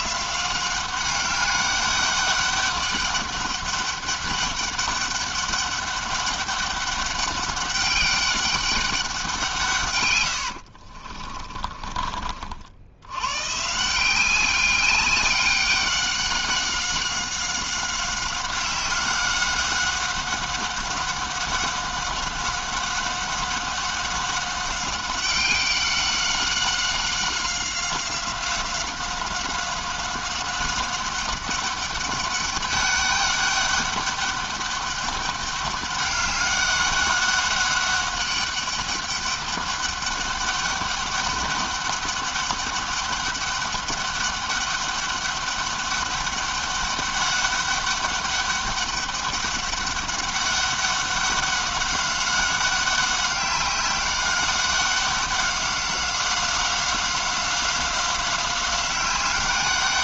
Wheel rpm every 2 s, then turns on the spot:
190, 200, 200, 200, 200, 70, 70, 200, 190, 190, 190, 200, 190, 190, 190, 190, 200, 200, 200, 200, 200, 200, 200, 200, 200, 200, 200, 200, 190, 190.
10-12